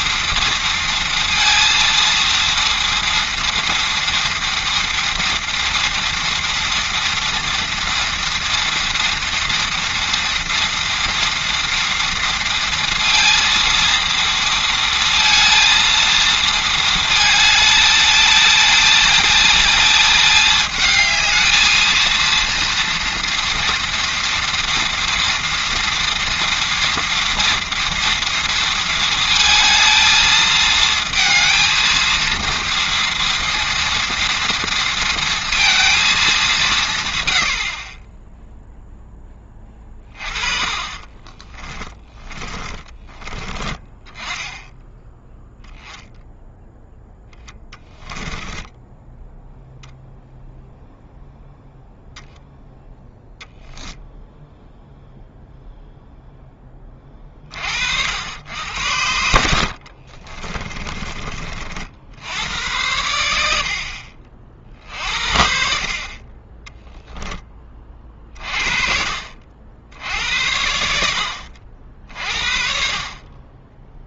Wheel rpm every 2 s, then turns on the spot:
230, 230, 230, 230, 230, 230, 230, 230, 220, 220, 220, 230, 230, 230, 230, 220, 230, 230, 170, 0, 30, 20, 10, 0, 10, 0, 0, 0, 20, 80, 30, 90, 50, 10, 40, 70, 50.
40-44 60-62 66-68